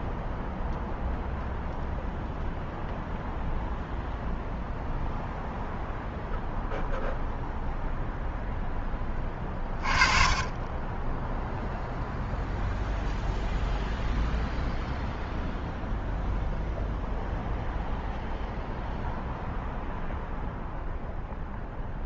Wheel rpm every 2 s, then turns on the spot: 0, 0, 0, 0, 20, 10, 0, 0, 0, 0, 0.
none